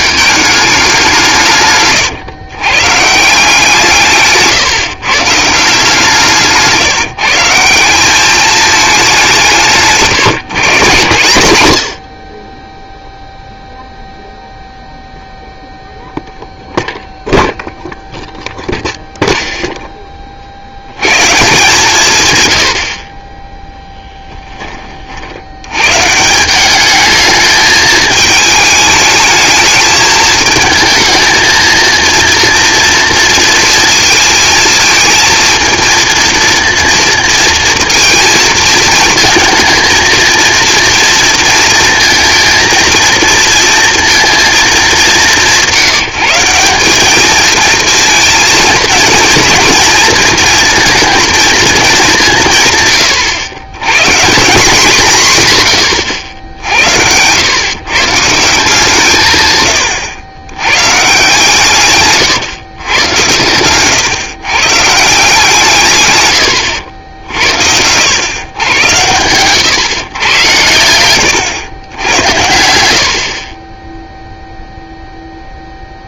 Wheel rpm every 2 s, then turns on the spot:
190, 130, 150, 160, 210, 170, 10, 0, 0, 0, 80, 80, 20, 200, 220, 220, 230, 230, 240, 230, 230, 230, 220, 190, 220, 230, 130, 170, 70, 170, 130, 120, 140, 80, 110, 100, 80, 0.
70-72